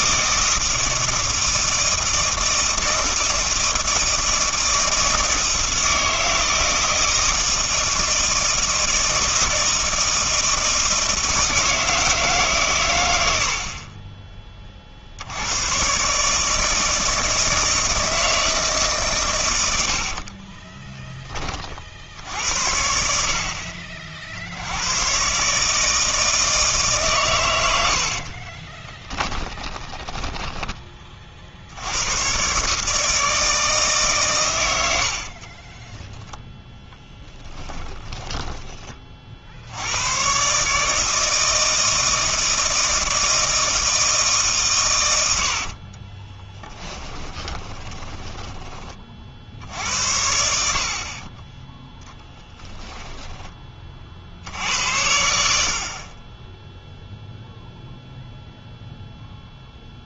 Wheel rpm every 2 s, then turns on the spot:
160, 160, 160, 160, 160, 160, 140, 30, 160, 150, 20, 60, 90, 160, 30, 20, 140, 90, 10, 20, 150, 160, 140, 20, 20, 50, 10, 70, 10, 0.
20-22 28-30 46-48 52-54